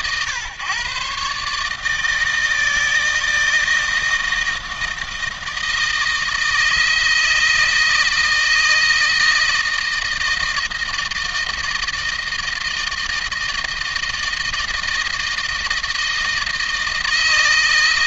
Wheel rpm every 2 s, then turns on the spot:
130, 160, 160, 160, 160, 160, 160, 160, 160.
none